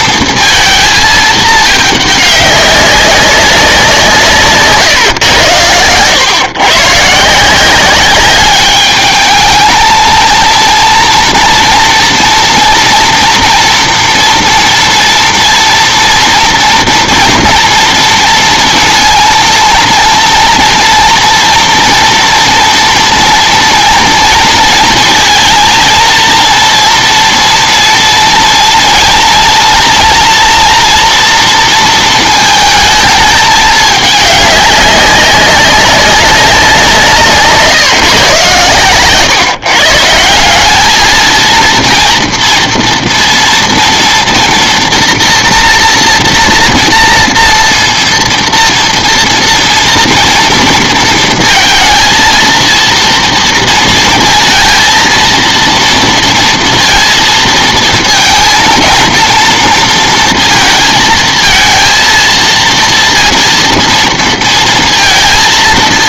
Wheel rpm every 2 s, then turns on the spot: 230, 200, 150, 130, 200, 230, 240, 230, 230, 230, 230, 230, 230, 230, 230, 240, 230, 200, 190, 130, 190, 230, 240, 240, 230, 230, 230, 230, 230, 230, 230, 230, 230.
none